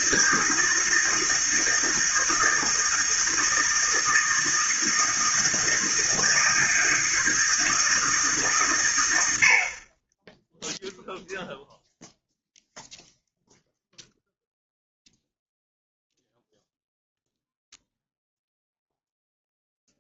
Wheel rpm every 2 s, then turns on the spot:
160, 160, 160, 160, 160, 20, 0, 0, 0, 0.
none